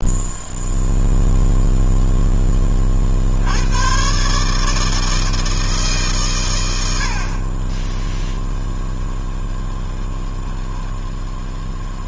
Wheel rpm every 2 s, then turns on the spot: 0, 30, 160, 80, 0, 10.
none